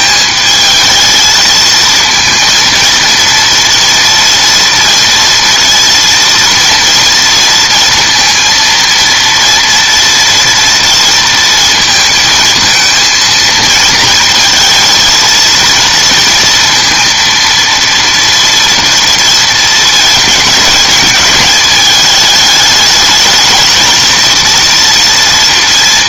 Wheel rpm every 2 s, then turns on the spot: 220, 230, 230, 230, 230, 230, 220, 230, 230, 230, 220, 210, 230.
none